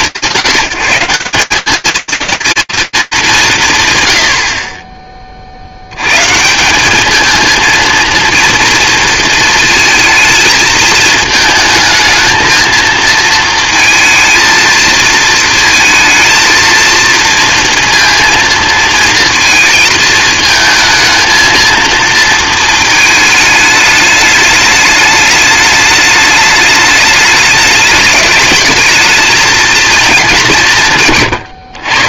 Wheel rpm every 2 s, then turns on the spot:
170, 230, 70, 170, 230, 220, 230, 220, 230, 230, 220, 230, 210, 210, 210, 180.
none